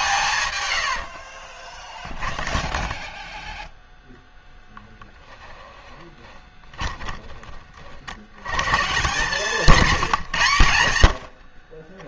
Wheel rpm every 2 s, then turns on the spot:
80, 0, 20, 20, 130, 80.
0-2 4-8